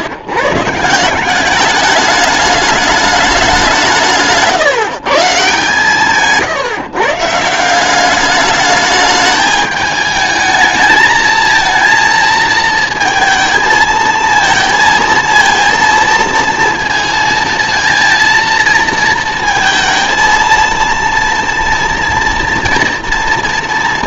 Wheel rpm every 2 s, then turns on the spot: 150, 210, 140, 140, 210, 220, 230, 230, 230, 230, 230, 230.
none